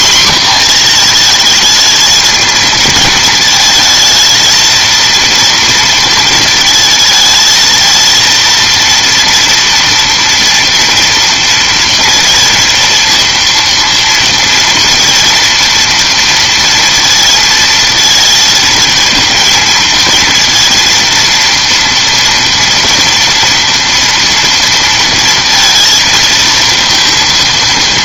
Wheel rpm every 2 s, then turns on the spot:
230, 220, 230, 220, 230, 230, 230, 230, 230, 230, 230, 230, 230, 230.
none